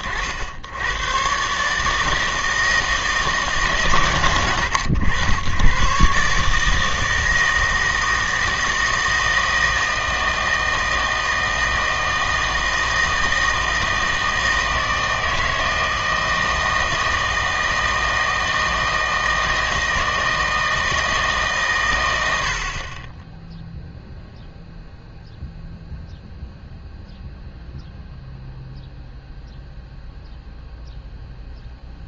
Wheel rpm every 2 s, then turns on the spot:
100, 160, 110, 150, 160, 160, 160, 160, 160, 160, 160, 60, 0, 0, 0, 0.
none